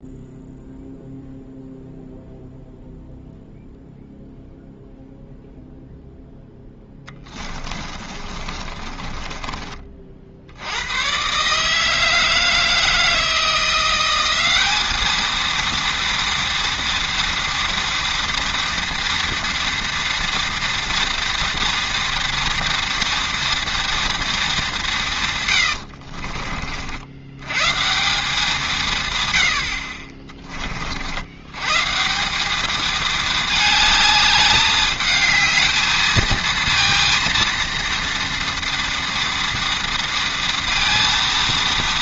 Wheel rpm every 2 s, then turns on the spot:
0, 0, 0, 20, 20, 130, 160, 220, 230, 230, 230, 230, 140, 110, 120, 90, 220, 220, 230, 230, 230.
6-8